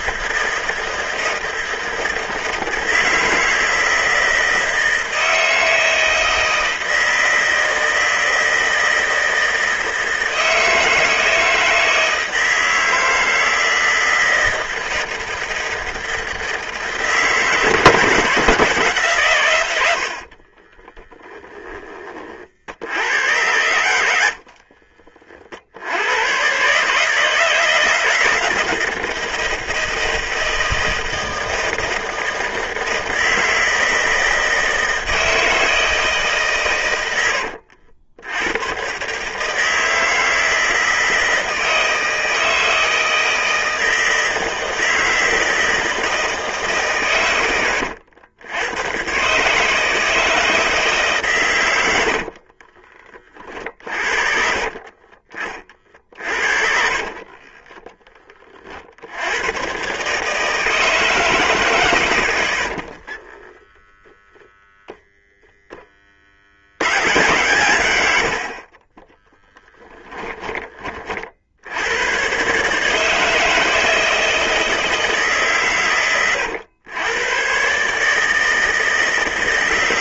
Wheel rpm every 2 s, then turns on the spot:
160, 160, 160, 160, 160, 160, 160, 160, 160, 170, 40, 60, 60, 130, 170, 170, 160, 160, 140, 110, 160, 160, 160, 150, 100, 160, 60, 40, 50, 40, 150, 80, 10, 70, 60, 20, 140, 160, 100, 160.
20-22 24-26 52-54 56-58 62-64 68-70